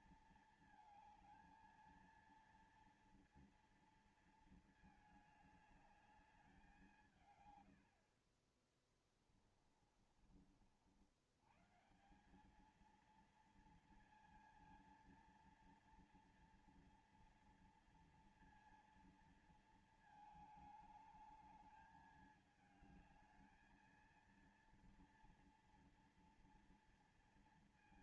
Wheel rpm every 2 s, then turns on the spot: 230, 230, 220, 200, 40, 50, 190, 230, 230, 230, 220, 220, 230, 230.
none